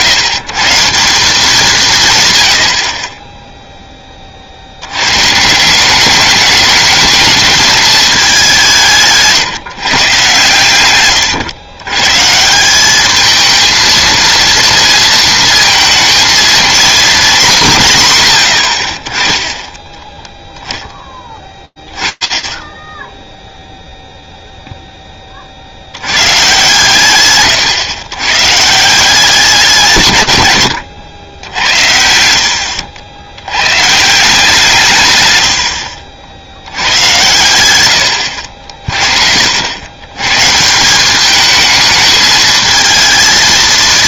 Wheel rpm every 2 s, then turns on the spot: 150, 80, 60, 210, 190, 120, 170, 230, 230, 80, 10, 10, 0, 130, 150, 100, 80, 150, 90, 50, 190, 220.
30-32